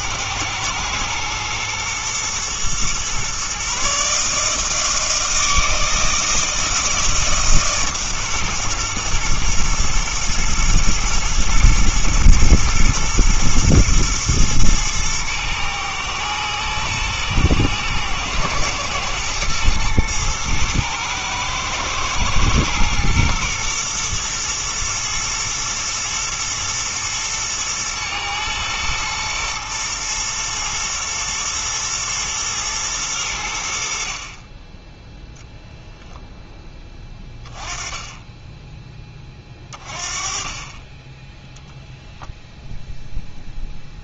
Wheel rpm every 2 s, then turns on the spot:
110, 120, 160, 160, 120, 120, 120, 110, 110, 110, 110, 120, 110, 110, 110, 120, 110, 30, 10, 10, 30, 0.
none